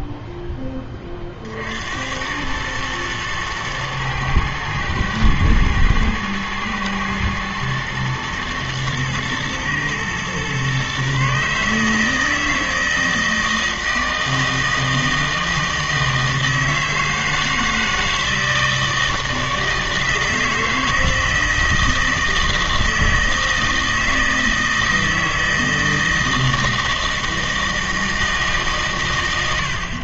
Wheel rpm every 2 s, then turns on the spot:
20, 110, 110, 110, 110, 130, 160, 160, 160, 160, 160, 160, 160, 160, 140.
none